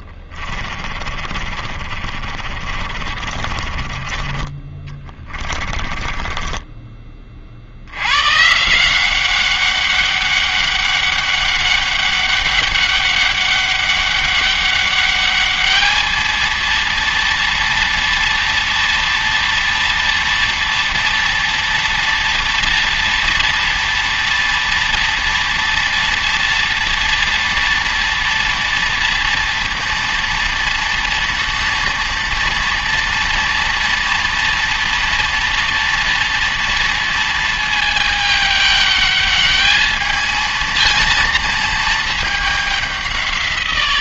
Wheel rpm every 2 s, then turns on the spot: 30, 30, 20, 10, 150, 200, 200, 200, 230, 230, 230, 230, 230, 230, 230, 230, 230, 230, 230, 210, 230, 200.
0-8